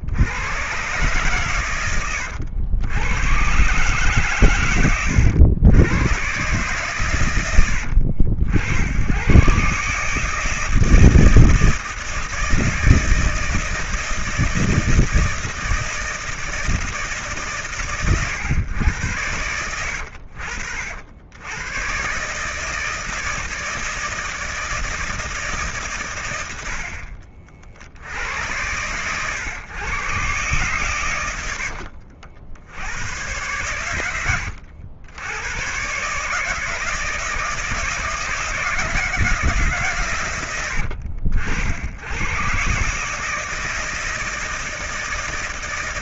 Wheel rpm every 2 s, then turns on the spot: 100, 90, 120, 130, 80, 160, 160, 170, 160, 110, 70, 150, 160, 90, 100, 130, 80, 90, 150, 170, 90, 120, 160.
none